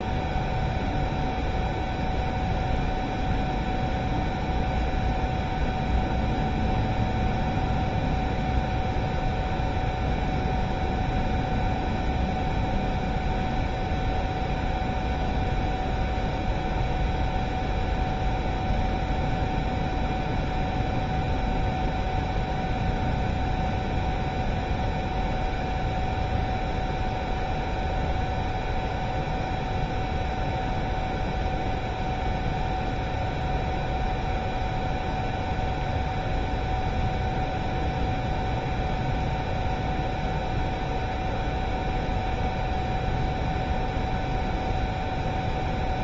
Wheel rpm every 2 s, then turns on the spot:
0, 0, 0, 0, 0, 0, 0, 0, 0, 0, 0, 0, 0, 0, 0, 0, 0, 0, 0, 0, 0, 0, 0.
none